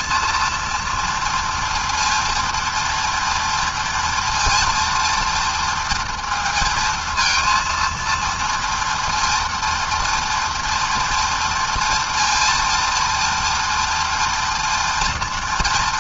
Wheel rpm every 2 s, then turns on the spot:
230, 230, 230, 230, 230, 240, 230, 240.
none